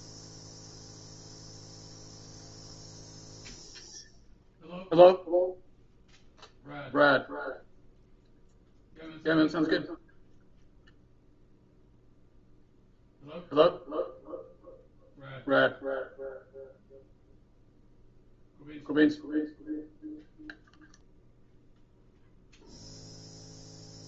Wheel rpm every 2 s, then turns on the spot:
0, 0, 0, 0, 0, 0, 0, 0, 0, 0, 0, 0.
none